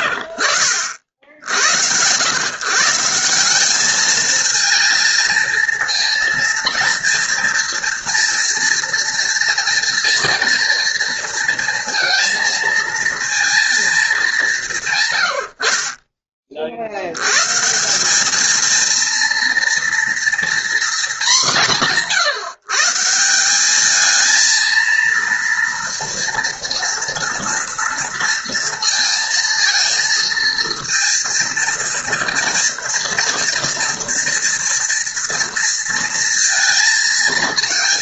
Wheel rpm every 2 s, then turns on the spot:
70, 150, 230, 230, 230, 230, 230, 150, 60, 230, 230, 160, 230, 230, 230, 230, 230, 230, 230.
none